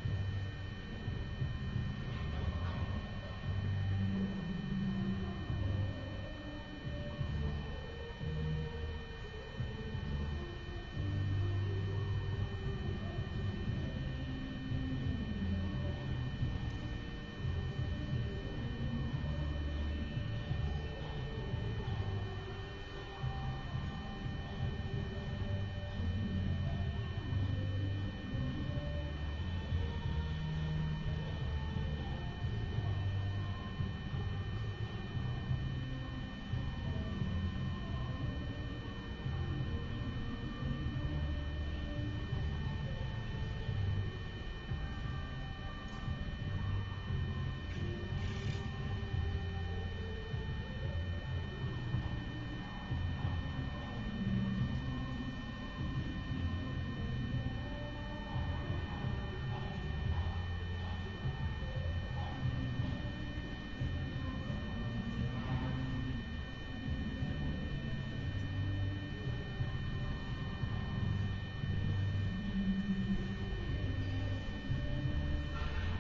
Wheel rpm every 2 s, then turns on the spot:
0, 0, 0, 0, 0, 0, 0, 0, 0, 0, 0, 0, 0, 0, 0, 0, 0, 0, 0, 0, 0, 0, 0, 0, 0, 0, 0, 0, 0, 0, 0, 0, 0, 0, 0, 0, 0, 0.
none